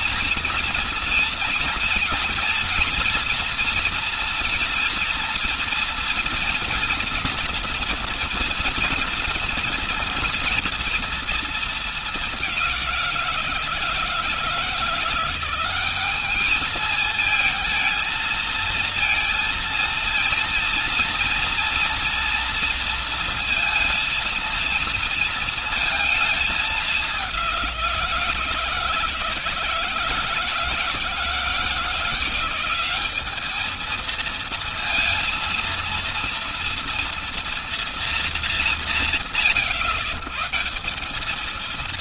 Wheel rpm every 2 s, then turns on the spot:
230, 240, 230, 230, 230, 230, 200, 160, 210, 220, 230, 230, 230, 210, 160, 160, 180, 220, 230, 200, 130.
none